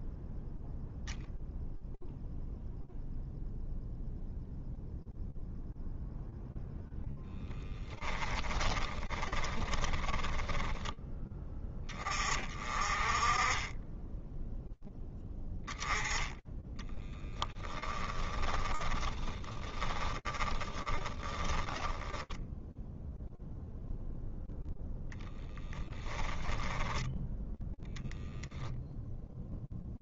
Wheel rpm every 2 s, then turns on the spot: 0, 0, 0, 0, 20, 10, 30, 10, 10, 30, 10, 0, 10, 10, 0.
8-10 16-22